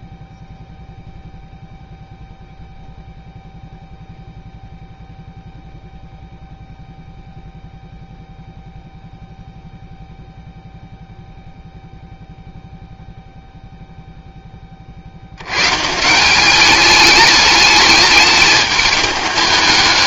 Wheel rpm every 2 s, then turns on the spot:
0, 0, 0, 0, 0, 0, 0, 30, 200, 210.
none